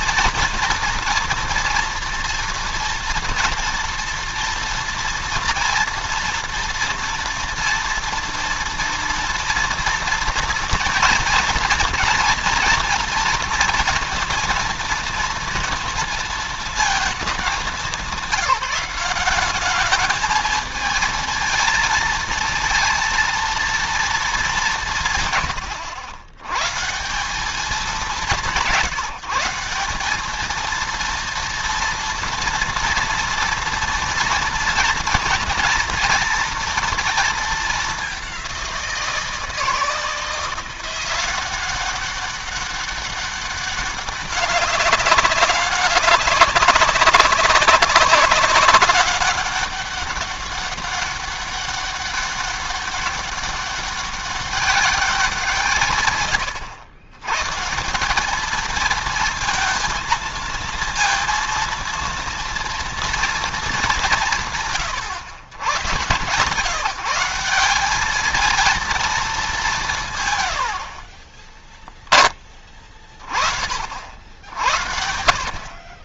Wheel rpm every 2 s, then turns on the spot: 230, 230, 230, 240, 230, 230, 240, 230, 220, 190, 220, 230, 170, 130, 160, 230, 230, 240, 230, 180, 170, 200, 200, 190, 190, 200, 200, 190, 90, 220, 230, 230, 140, 170, 230, 70, 30, 70.
70-72